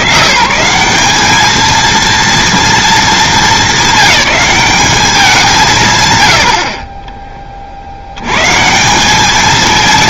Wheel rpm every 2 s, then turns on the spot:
160, 230, 210, 50, 170.
none